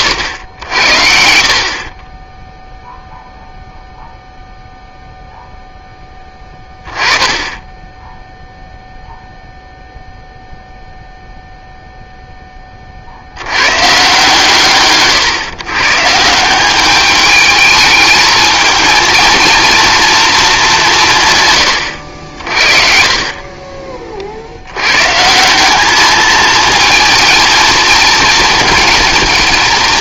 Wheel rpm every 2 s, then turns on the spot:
80, 0, 0, 20, 0, 0, 20, 130, 190, 220, 190, 50, 100, 220, 230.
none